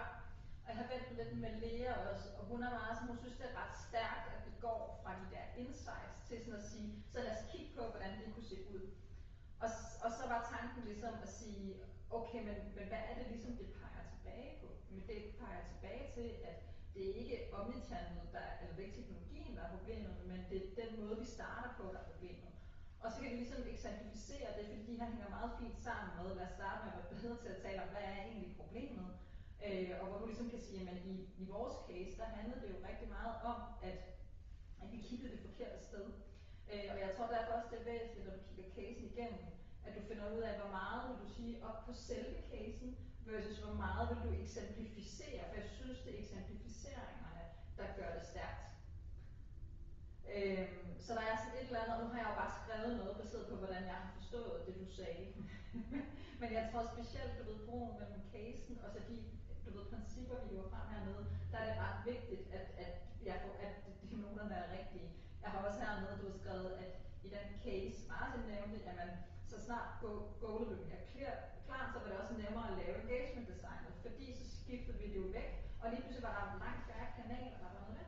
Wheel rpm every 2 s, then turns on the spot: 0, 0, 0, 0, 0, 0, 0, 0, 0, 0, 0, 0, 0, 0, 0, 0, 0, 0, 0, 0, 0, 0, 0, 0, 0, 0, 0, 0, 0, 0, 0, 0, 0, 0, 0, 0, 0, 0, 0.
none